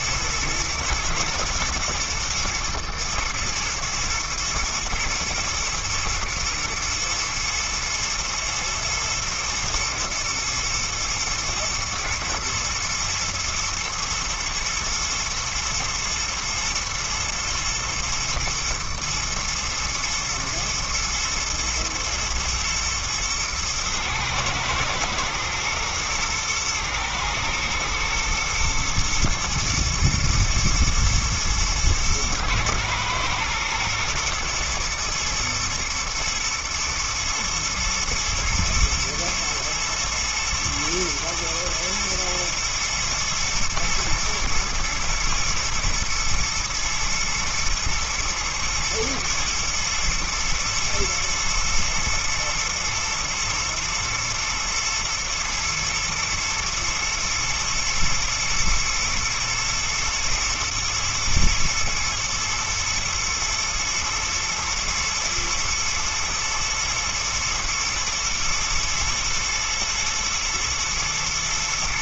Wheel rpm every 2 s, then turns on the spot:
110, 120, 120, 120, 110, 110, 110, 110, 110, 110, 110, 110, 110, 120, 120, 120, 110, 110, 110, 110, 120, 110, 110, 120, 110, 110, 110, 110, 120, 110, 110, 110, 110, 120, 120, 120.
none